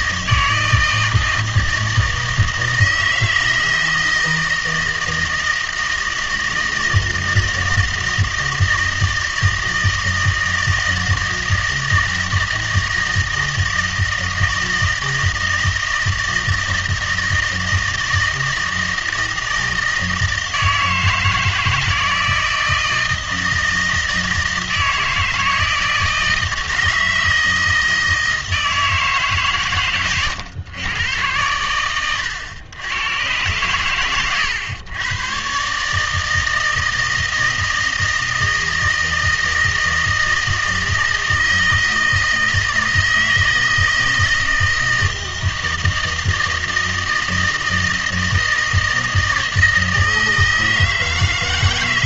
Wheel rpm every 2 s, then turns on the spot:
160, 160, 160, 160, 160, 160, 160, 160, 160, 160, 160, 160, 160, 160, 160, 120, 100, 110, 160, 160, 160, 160, 160, 160, 160, 160.
none